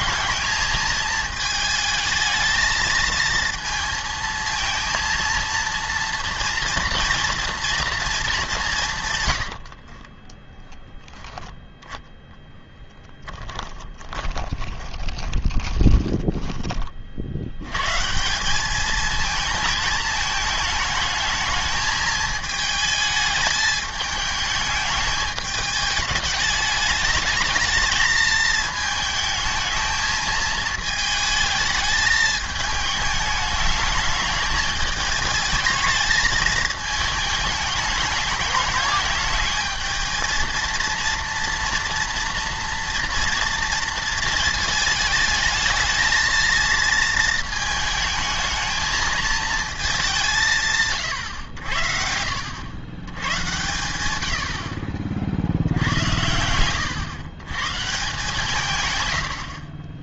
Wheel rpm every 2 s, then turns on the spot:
220, 220, 230, 230, 180, 10, 0, 20, 20, 200, 220, 220, 210, 210, 220, 220, 210, 210, 220, 210, 230, 230, 220, 230, 220, 140, 90, 70, 110, 130.
14-16